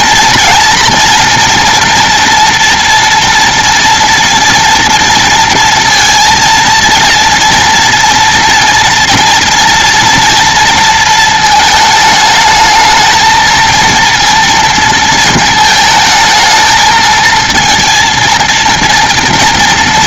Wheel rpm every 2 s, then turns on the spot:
230, 230, 230, 230, 230, 230, 220, 230, 220, 230.
none